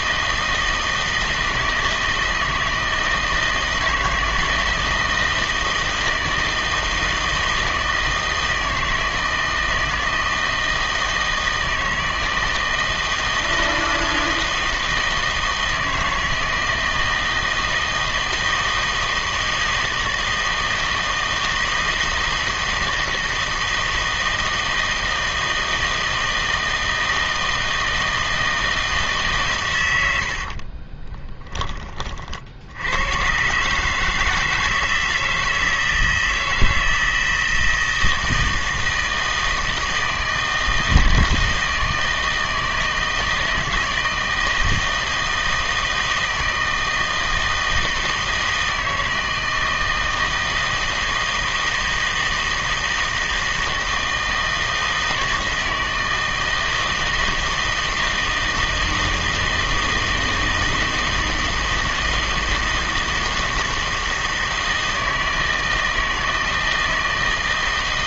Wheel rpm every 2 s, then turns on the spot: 160, 160, 160, 160, 160, 160, 160, 160, 160, 160, 160, 160, 160, 160, 160, 50, 70, 160, 160, 160, 160, 160, 160, 160, 160, 160, 160, 160, 160, 160, 160, 160, 160, 160.
30-32